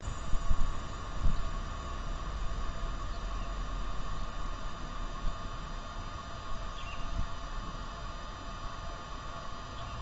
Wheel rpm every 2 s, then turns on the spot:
0, 0, 0, 0, 0.
none